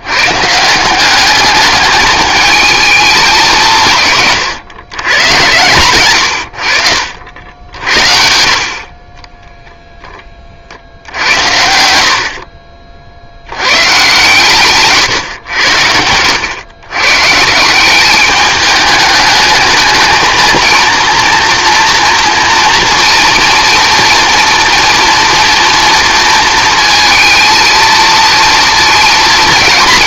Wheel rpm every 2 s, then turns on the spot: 170, 220, 120, 70, 50, 60, 50, 130, 120, 210, 230, 230, 240, 230, 230.
none